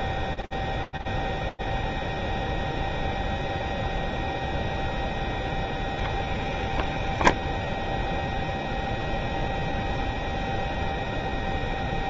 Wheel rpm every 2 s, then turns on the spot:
0, 0, 0, 0, 0, 20.
none